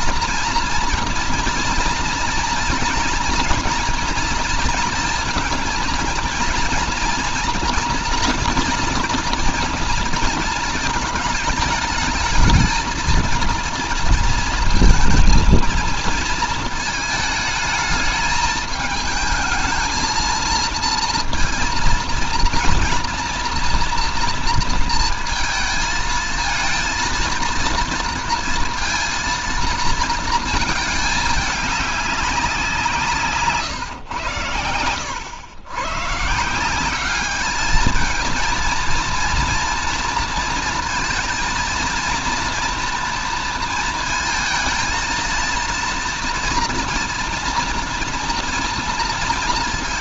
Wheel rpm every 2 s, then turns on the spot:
230, 230, 230, 230, 230, 230, 220, 230, 220, 220, 230, 230, 230, 220, 230, 220, 180, 100, 180, 230, 230, 230, 230, 230, 230.
none